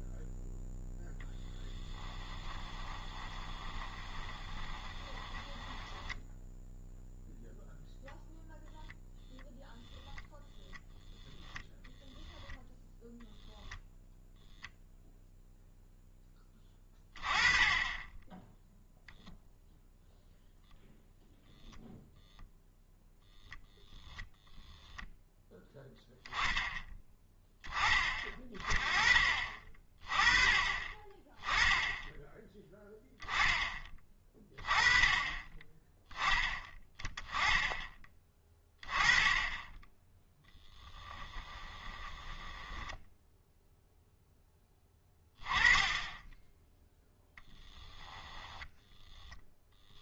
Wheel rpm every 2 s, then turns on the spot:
0, 20, 20, 0, 0, 0, 0, 0, 20, 0, 0, 0, 0, 10, 20, 20, 10, 20, 10, 20, 10, 10, 10, 10, 10.
2-6 40-44 48-50